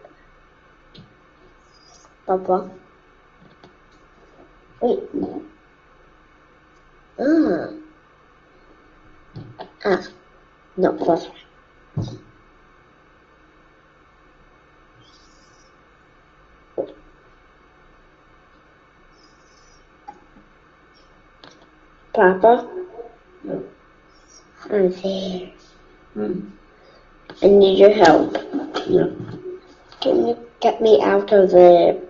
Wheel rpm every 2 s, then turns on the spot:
0, 0, 0, 0, 0, 0, 0, 0, 0, 0, 0, 0, 0, 0, 0, 0.
none